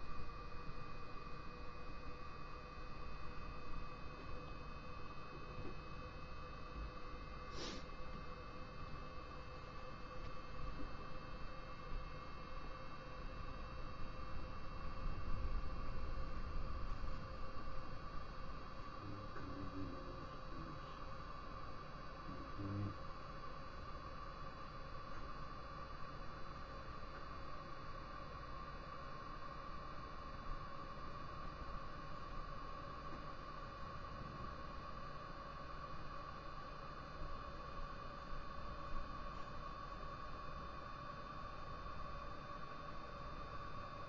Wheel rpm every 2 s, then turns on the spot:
0, 0, 0, 0, 0, 0, 0, 0, 0, 0, 0, 0, 0, 0, 0, 0, 0, 0, 0, 0, 0, 0.
none